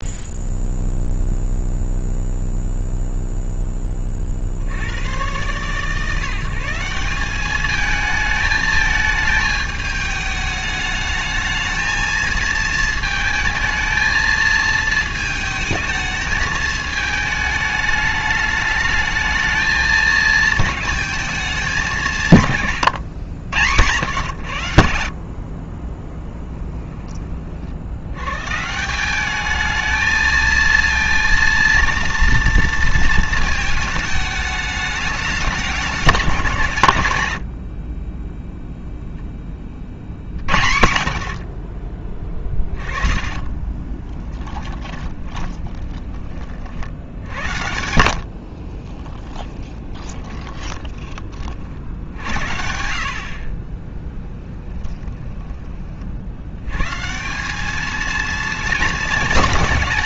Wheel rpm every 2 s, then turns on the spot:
0, 0, 40, 160, 220, 210, 230, 220, 210, 210, 220, 140, 90, 10, 140, 230, 230, 210, 160, 0, 60, 20, 10, 50, 30, 20, 60, 20, 130, 220.
22-24 42-46 48-52 54-56